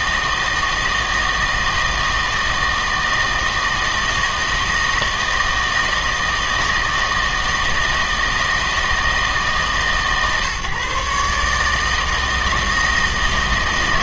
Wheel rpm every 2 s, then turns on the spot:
160, 160, 160, 160, 160, 140, 160.
none